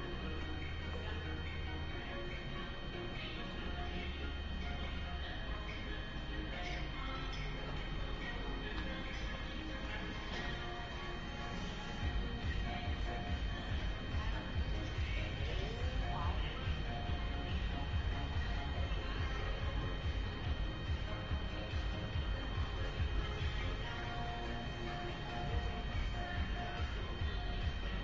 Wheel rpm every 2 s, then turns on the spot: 0, 0, 0, 0, 0, 0, 0, 0, 0, 0, 0, 0, 0, 0.
none